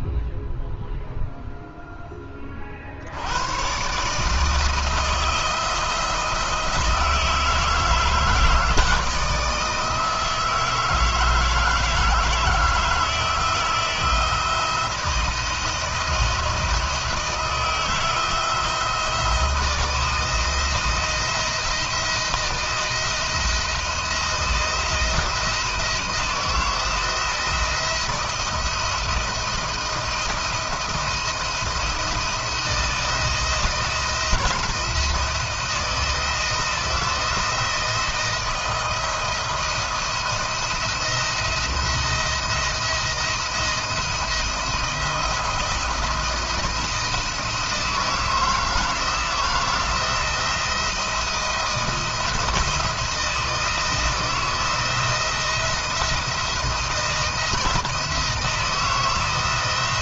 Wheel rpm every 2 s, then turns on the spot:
0, 40, 160, 160, 160, 160, 160, 160, 170, 170, 170, 160, 160, 170, 170, 170, 170, 160, 170, 170, 170, 170, 170, 170, 160, 170, 170, 160, 170, 160.
none